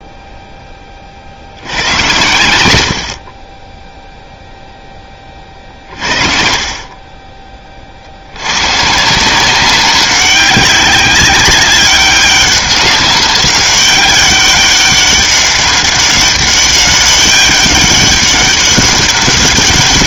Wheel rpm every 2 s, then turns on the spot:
20, 90, 0, 40, 120, 200, 200, 200, 200, 200.
none